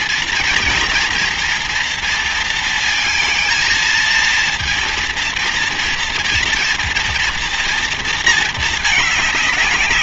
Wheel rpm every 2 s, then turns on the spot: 230, 230, 230, 240, 220.
none